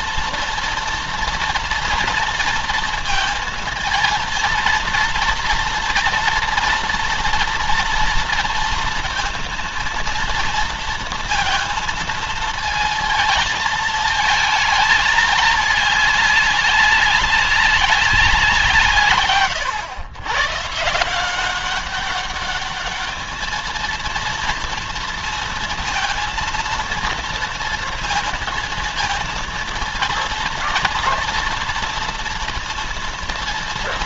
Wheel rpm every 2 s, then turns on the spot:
230, 230, 230, 230, 230, 230, 230, 220, 200, 160, 150, 210, 230, 230, 230, 230, 230.
none